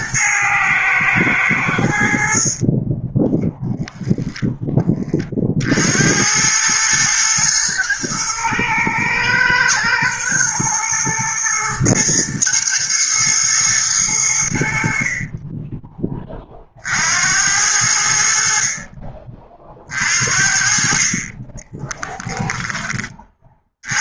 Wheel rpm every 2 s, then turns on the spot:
110, 20, 30, 110, 110, 110, 120, 50, 70, 40, 30, 20.
2-4